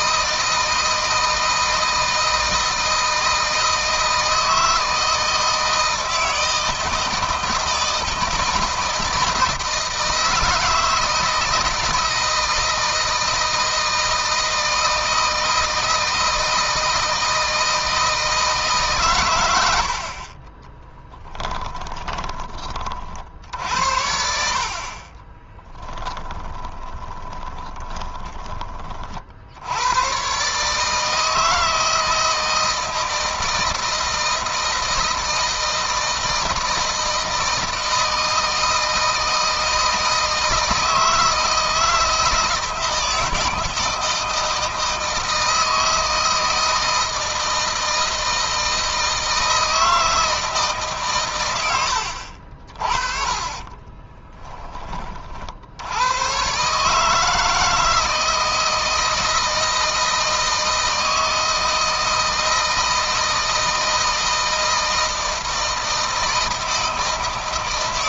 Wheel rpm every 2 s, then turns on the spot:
160, 160, 160, 160, 160, 160, 160, 160, 160, 140, 20, 40, 40, 20, 40, 150, 160, 160, 160, 160, 160, 160, 160, 160, 160, 140, 40, 30, 140, 160, 160, 160, 160, 160.
20-22 24-28